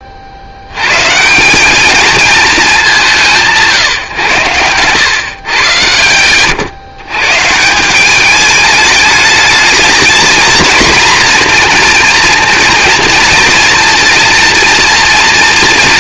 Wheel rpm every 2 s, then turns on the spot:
110, 200, 110, 120, 210, 230, 230, 240.
none